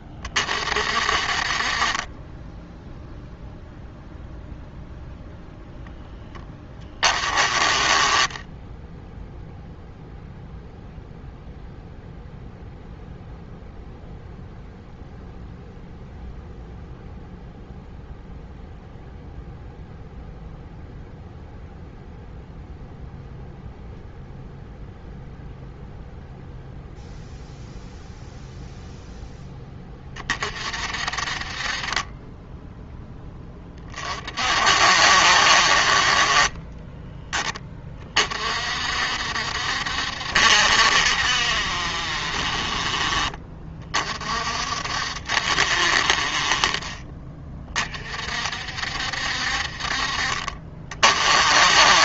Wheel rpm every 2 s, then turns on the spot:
40, 0, 0, 20, 0, 0, 0, 0, 0, 0, 0, 0, 0, 0, 0, 50, 10, 60, 20, 60, 60, 40, 60, 30, 60, 40.
36-38